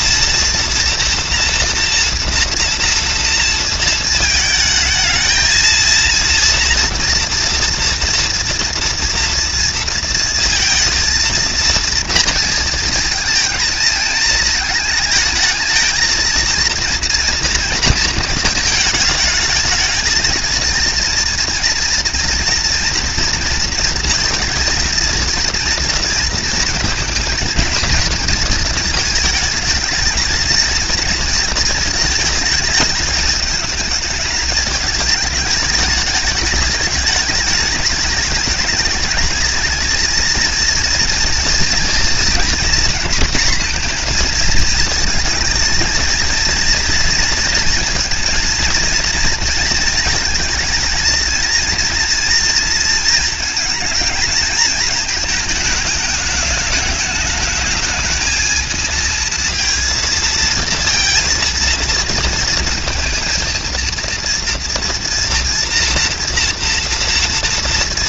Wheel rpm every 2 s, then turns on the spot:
230, 230, 220, 230, 230, 230, 230, 220, 230, 220, 230, 230, 230, 230, 220, 230, 220, 220, 220, 220, 230, 240, 220, 230, 240, 220, 230, 220, 210, 220, 230, 230, 240, 230.
none